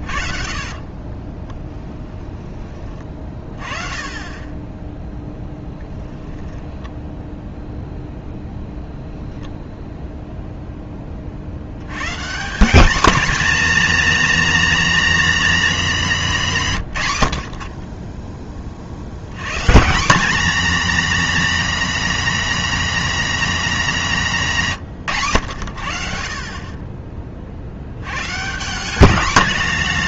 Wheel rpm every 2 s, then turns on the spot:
40, 30, 10, 0, 0, 10, 210, 240, 140, 50, 240, 220, 140, 30, 190.
0-2